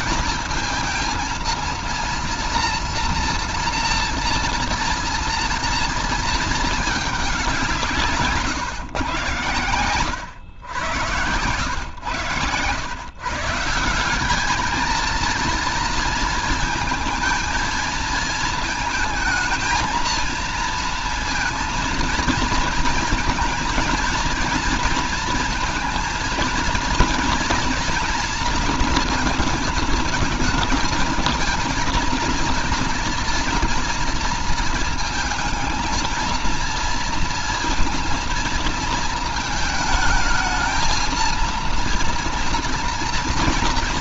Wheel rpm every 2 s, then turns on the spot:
220, 230, 230, 220, 140, 100, 110, 210, 220, 220, 220, 230, 230, 230, 230, 220, 230, 230, 220, 230, 220, 230.
none